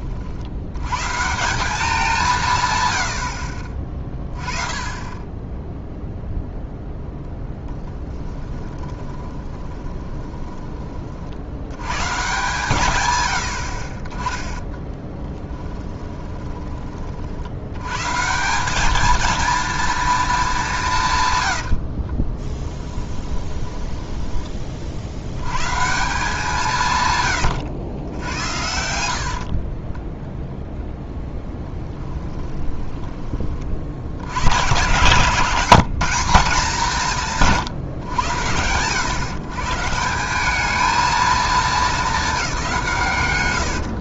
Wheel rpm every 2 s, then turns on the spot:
80, 140, 20, 0, 10, 20, 150, 20, 30, 180, 190, 20, 30, 160, 80, 0, 20, 100, 180, 100, 200, 190.
8-10 14-16 22-24 32-34